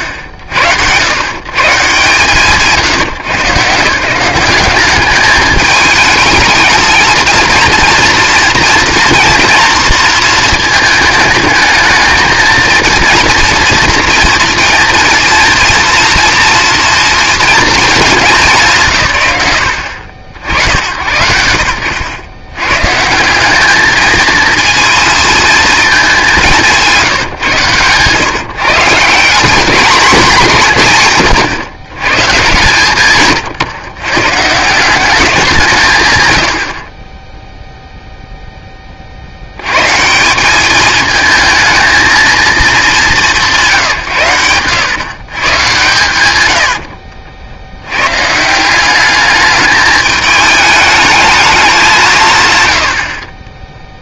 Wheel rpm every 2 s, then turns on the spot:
90, 130, 200, 220, 230, 220, 220, 230, 230, 180, 80, 120, 230, 190, 150, 170, 130, 160, 70, 10, 200, 220, 120, 90, 180, 210, 110.
26-28 44-46